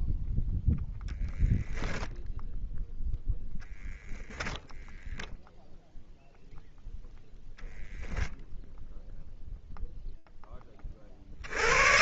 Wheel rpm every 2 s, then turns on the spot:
0, 0, 0, 0, 0, 80.
none